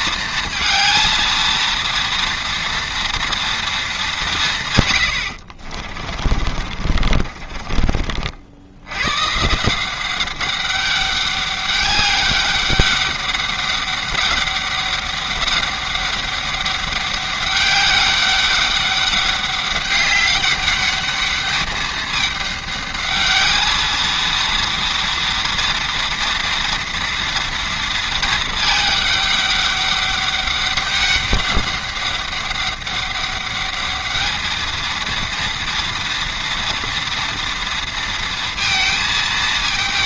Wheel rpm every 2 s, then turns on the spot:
230, 230, 140, 40, 80, 200, 200, 200, 200, 200, 200, 210, 230, 230, 220, 200, 200, 220, 230, 230.
6-8